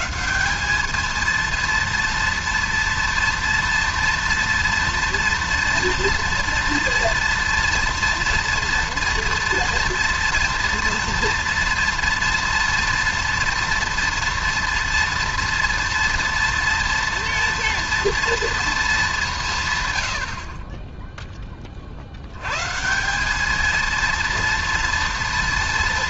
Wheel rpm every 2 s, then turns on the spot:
220, 230, 230, 230, 230, 230, 230, 230, 230, 220, 20, 140, 230.
none